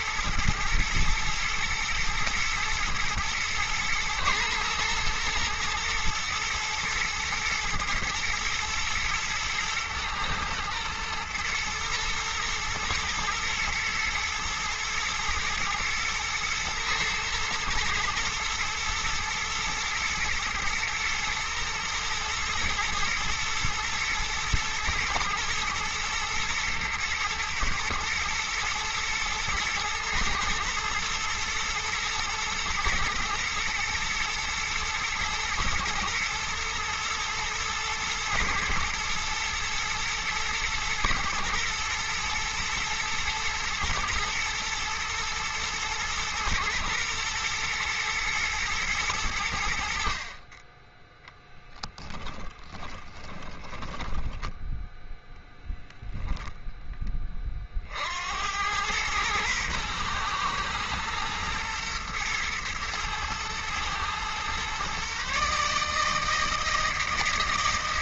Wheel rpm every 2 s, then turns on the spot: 110, 110, 110, 120, 110, 120, 120, 110, 120, 120, 110, 120, 110, 120, 110, 110, 110, 120, 120, 110, 110, 120, 110, 110, 110, 20, 10, 0, 10, 100, 110, 110, 130, 160.
52-54